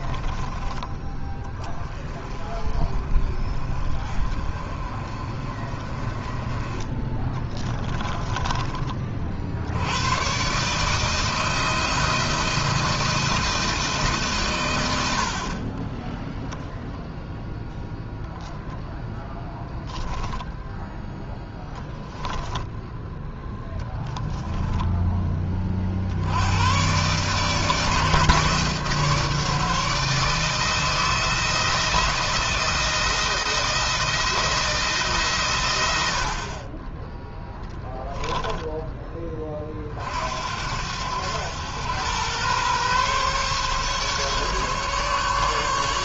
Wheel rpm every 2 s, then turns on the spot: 30, 30, 30, 20, 30, 150, 170, 100, 0, 0, 0, 0, 10, 120, 150, 160, 170, 150, 20, 10, 80, 130, 140.
6-8